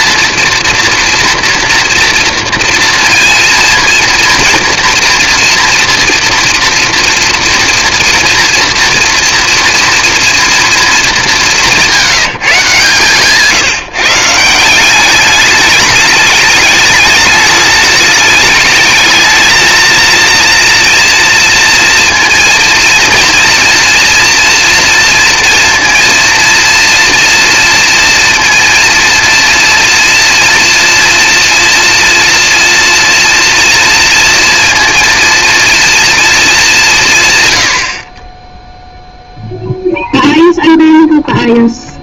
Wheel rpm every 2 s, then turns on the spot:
230, 230, 230, 230, 230, 230, 150, 170, 200, 210, 230, 230, 230, 230, 230, 240, 230, 230, 210, 10, 0.
none